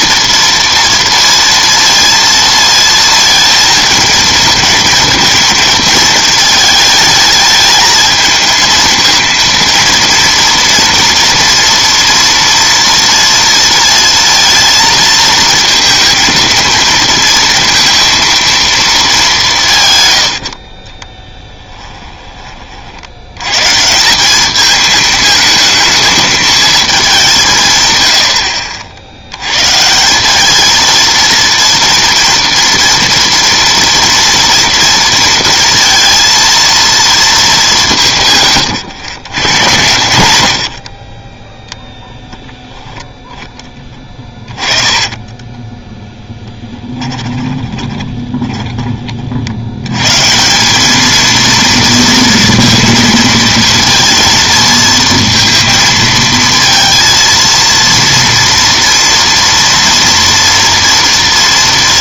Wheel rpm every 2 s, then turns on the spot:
230, 230, 220, 220, 220, 230, 230, 230, 230, 230, 60, 40, 210, 220, 60, 220, 230, 230, 230, 130, 60, 10, 20, 20, 30, 190, 230, 230, 230, 230, 230.
20-22 28-30 44-48